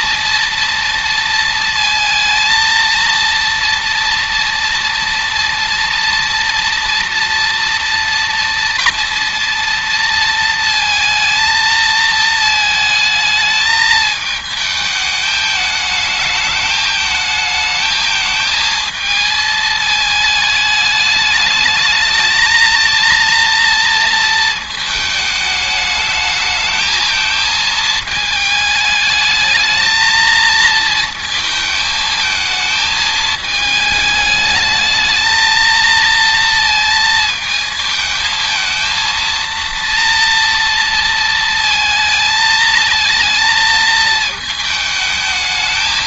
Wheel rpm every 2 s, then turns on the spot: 230, 230, 230, 230, 230, 230, 220, 220, 220, 220, 210, 230, 210, 220, 220, 220, 220, 220, 220, 230, 230, 220, 220.
none